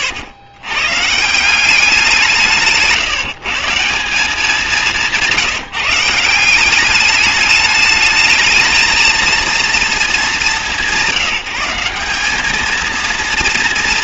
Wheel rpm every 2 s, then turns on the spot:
130, 180, 180, 200, 220, 190, 220.
2-4